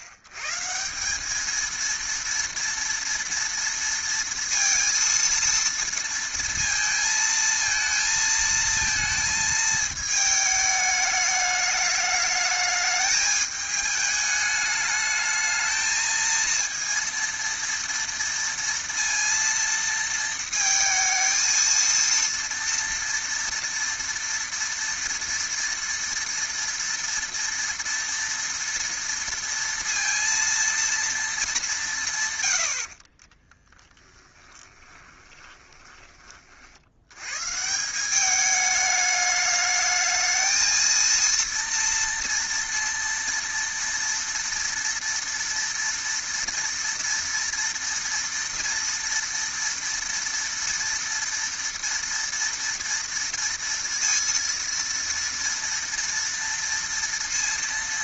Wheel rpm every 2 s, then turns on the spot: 110, 230, 230, 230, 220, 210, 210, 210, 230, 230, 230, 230, 230, 230, 230, 230, 110, 10, 50, 200, 220, 240, 230, 230, 230, 230, 230, 230, 230.
34-36